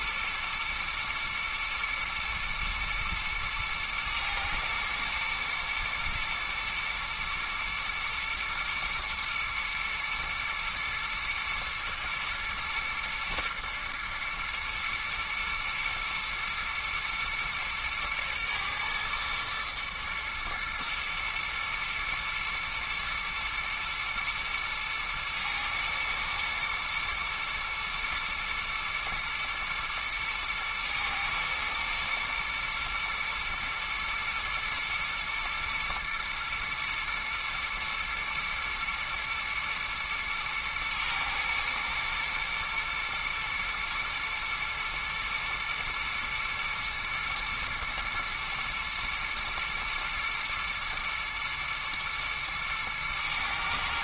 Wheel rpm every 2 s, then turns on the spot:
120, 120, 110, 120, 110, 120, 110, 120, 110, 110, 120, 110, 110, 120, 110, 110, 120, 120, 110, 120, 110, 120, 110, 120, 110, 120, 110.
none